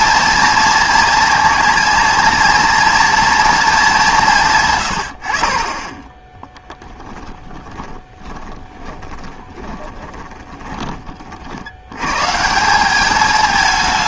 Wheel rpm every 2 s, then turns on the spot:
230, 230, 110, 10, 20, 20, 180.
6-10